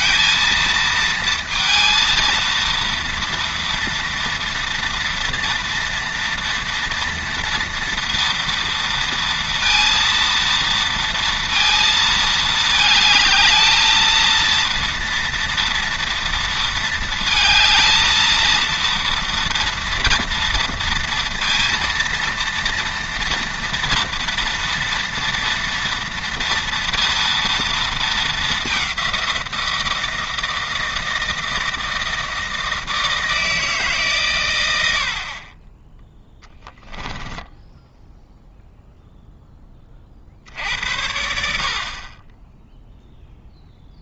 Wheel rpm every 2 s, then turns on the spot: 230, 230, 230, 240, 230, 230, 220, 230, 230, 230, 230, 230, 230, 230, 200, 160, 160, 100, 10, 0, 80, 0.
36-38